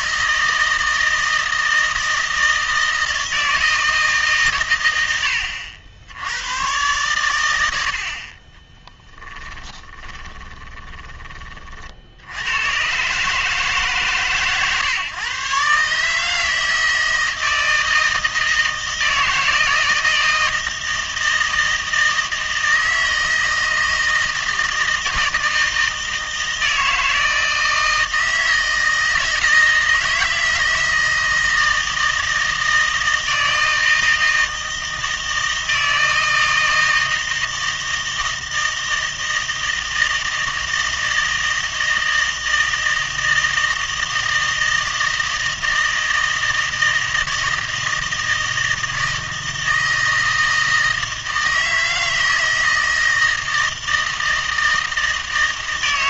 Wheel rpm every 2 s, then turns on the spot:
160, 160, 110, 120, 20, 20, 110, 140, 160, 160, 160, 160, 160, 160, 160, 160, 160, 160, 160, 160, 160, 160, 160, 160, 160, 160, 160, 160.
8-12